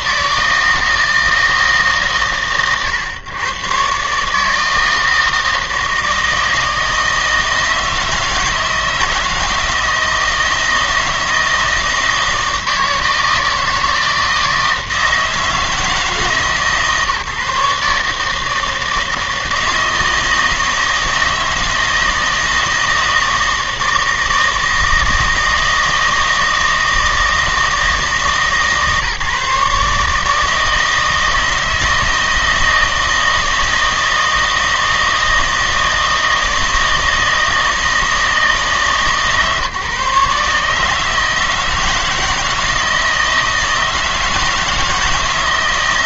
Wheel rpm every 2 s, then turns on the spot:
160, 120, 160, 160, 170, 160, 160, 160, 150, 160, 160, 160, 160, 160, 150, 160, 160, 160, 160, 160, 150, 160, 160.
none